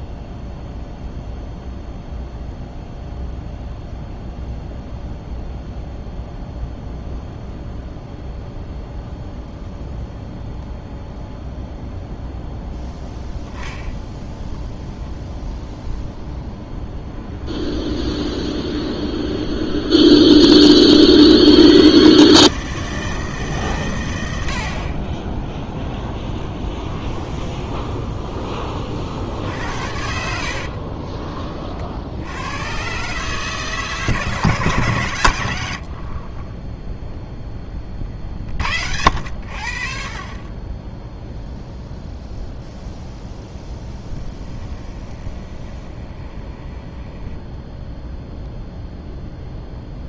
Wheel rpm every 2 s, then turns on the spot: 0, 0, 0, 0, 0, 0, 0, 0, 0, 10, 50, 160, 30, 10, 50, 30, 130, 110, 0, 70, 10, 0, 20, 10, 0.
18-20 26-28 30-32 44-48